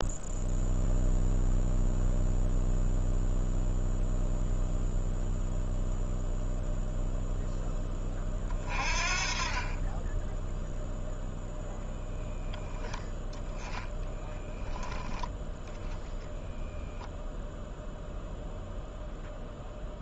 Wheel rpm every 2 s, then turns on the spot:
0, 0, 0, 0, 40, 0, 0, 10, 0, 0.
none